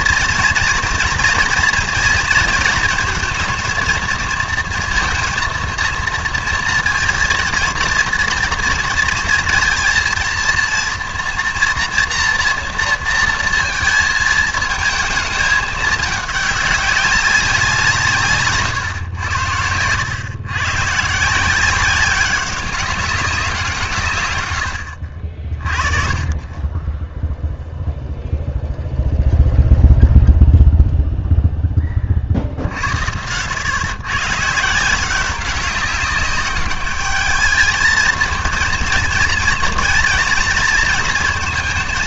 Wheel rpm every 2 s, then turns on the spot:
240, 230, 230, 230, 230, 230, 230, 220, 210, 140, 120, 190, 100, 20, 0, 0, 70, 150, 200, 230, 230.
none